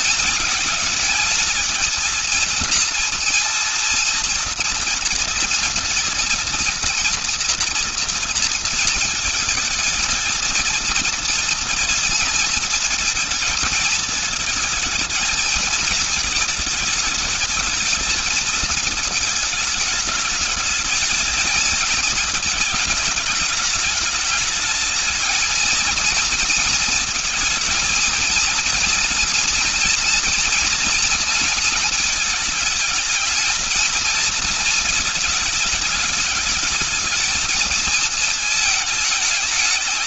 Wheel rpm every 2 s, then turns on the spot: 220, 230, 230, 230, 230, 230, 230, 220, 220, 220, 220, 220, 210, 220, 230, 230, 220, 230, 210, 220.
none